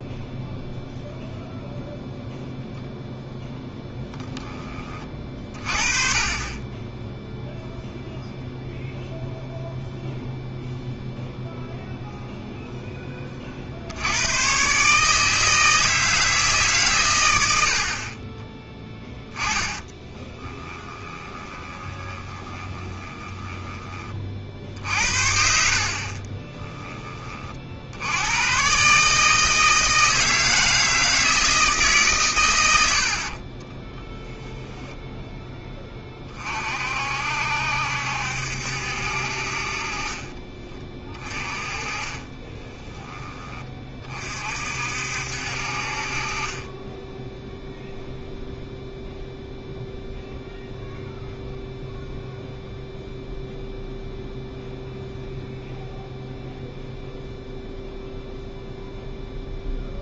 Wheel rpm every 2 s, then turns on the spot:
0, 0, 20, 20, 0, 0, 0, 130, 150, 20, 20, 20, 50, 20, 120, 160, 100, 0, 40, 70, 30, 20, 50, 30, 0, 0, 0, 0, 0, 0.
20-28 40-44